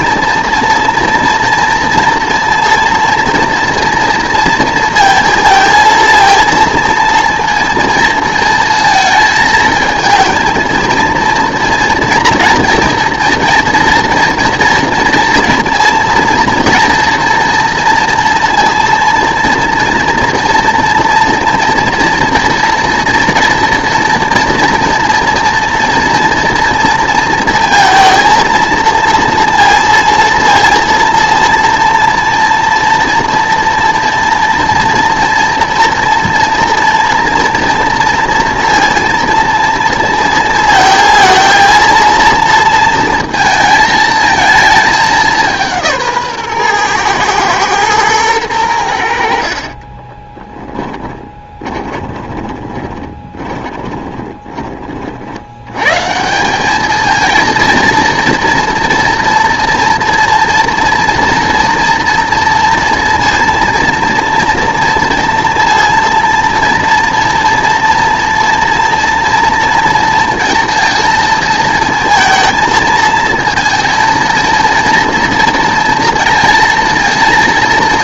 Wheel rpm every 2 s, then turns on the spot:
240, 230, 230, 230, 230, 230, 240, 230, 230, 230, 230, 230, 230, 230, 230, 230, 230, 230, 230, 230, 230, 230, 220, 130, 100, 10, 20, 20, 190, 240, 230, 230, 230, 230, 230, 230, 220, 230, 230.
50-54